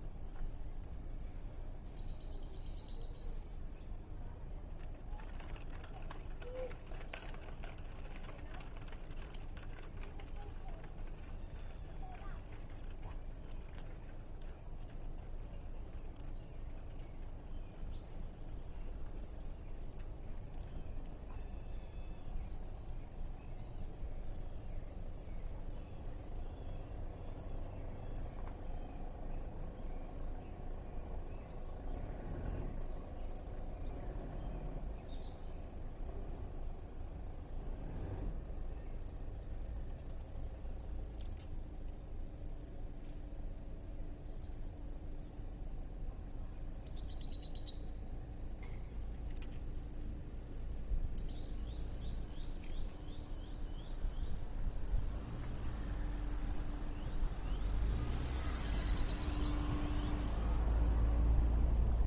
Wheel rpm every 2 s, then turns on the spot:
0, 0, 0, 0, 0, 0, 0, 0, 0, 0, 0, 0, 0, 0, 0, 0, 0, 0, 0, 0, 0, 0, 0, 0, 0, 0, 0, 0, 0, 0, 0.
none